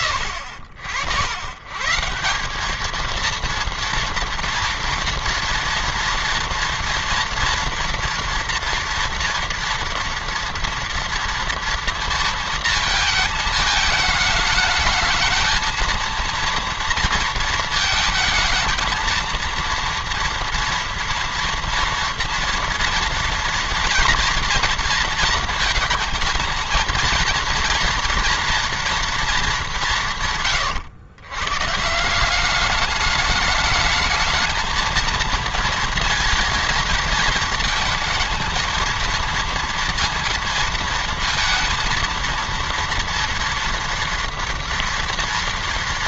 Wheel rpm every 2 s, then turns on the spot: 90, 200, 230, 230, 240, 230, 230, 220, 230, 220, 230, 230, 240, 230, 230, 150, 200, 220, 220, 220, 230, 230, 240.
none